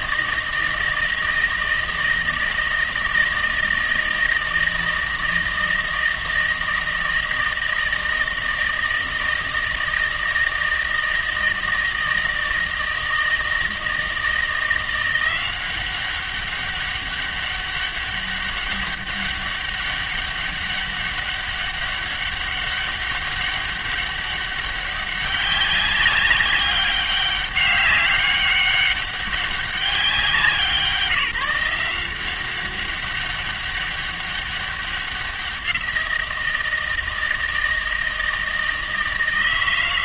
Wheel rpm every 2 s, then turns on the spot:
160, 160, 160, 160, 160, 160, 160, 170, 200, 200, 200, 200, 200, 200, 200, 180, 190, 190, 160, 160.
none